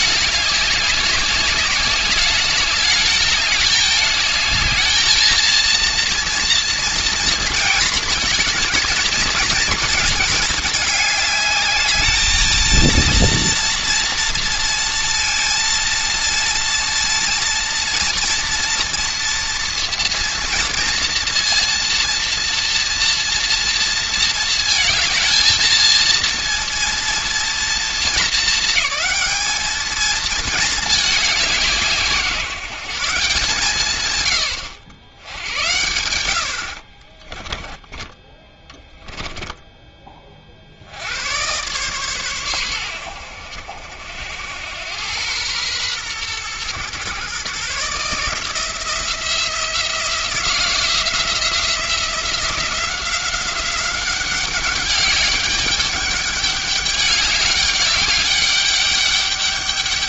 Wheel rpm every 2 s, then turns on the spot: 200, 200, 210, 230, 230, 220, 220, 230, 230, 230, 230, 230, 220, 230, 220, 220, 160, 100, 60, 10, 60, 110, 90, 120, 170, 170, 180, 200, 200, 200.
38-40